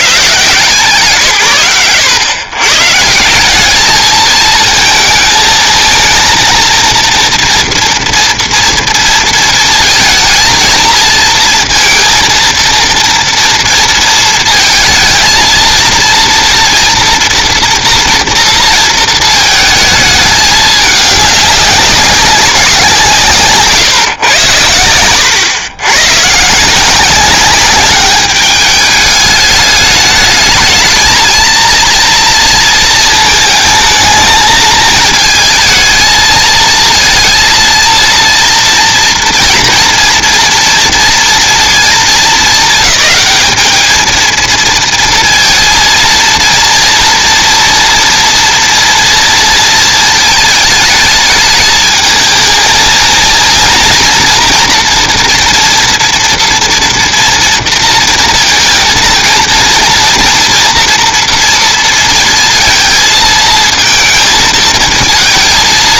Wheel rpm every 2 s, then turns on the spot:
120, 130, 220, 230, 230, 220, 230, 230, 230, 230, 210, 180, 100, 160, 200, 210, 230, 220, 230, 230, 230, 220, 230, 230, 230, 220, 220, 230, 230, 230, 230, 230, 220.
none